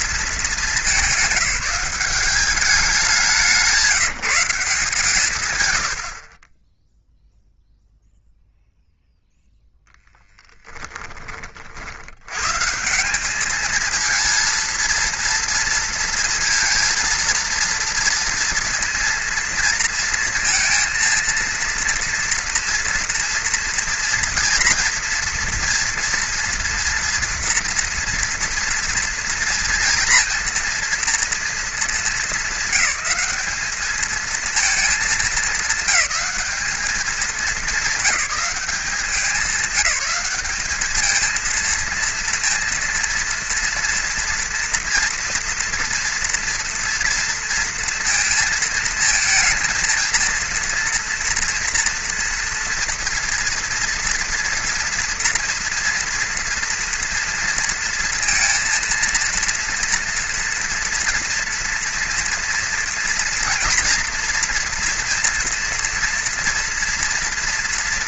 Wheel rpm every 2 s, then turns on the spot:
200, 190, 160, 10, 0, 10, 160, 230, 230, 230, 230, 230, 230, 230, 230, 230, 200, 220, 200, 190, 210, 230, 230, 230, 220, 230, 240, 230, 230, 230, 230, 230, 230, 230.
none